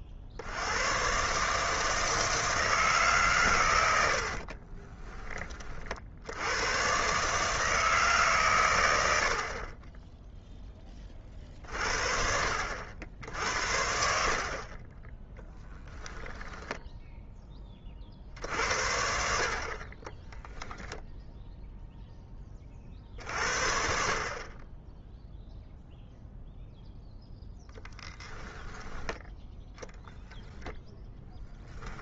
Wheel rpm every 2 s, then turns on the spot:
60, 160, 40, 110, 110, 10, 70, 40, 0, 70, 0, 20, 30, 0, 10, 0.
4-6